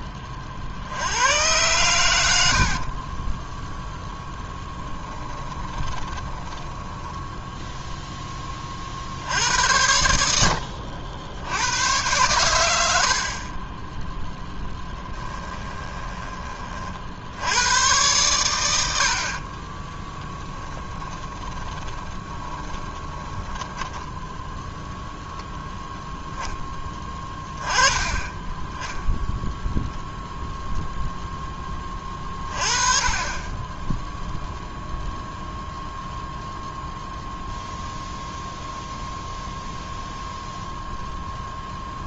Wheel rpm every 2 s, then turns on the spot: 80, 50, 10, 10, 40, 80, 70, 10, 50, 90, 10, 20, 0, 10, 10, 0, 30, 10, 0, 0, 0.
2-8 14-16 20-24 32-34